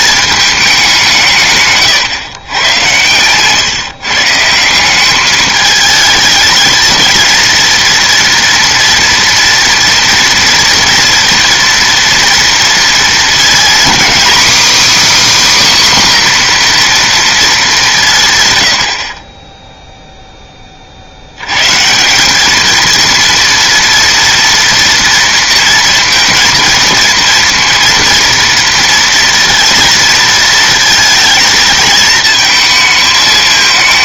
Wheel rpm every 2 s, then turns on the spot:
200, 120, 170, 230, 230, 240, 230, 290, 250, 100, 30, 220, 230, 230, 230, 230, 220.
none